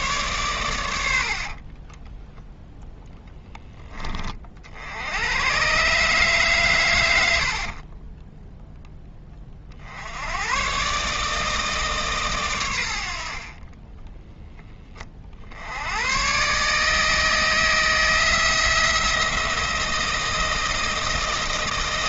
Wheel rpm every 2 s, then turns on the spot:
100, 0, 60, 120, 10, 120, 110, 10, 150, 170, 170.
none